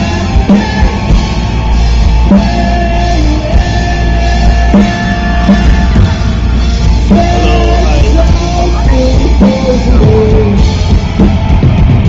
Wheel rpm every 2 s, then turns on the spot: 0, 0, 0, 0, 0, 0.
none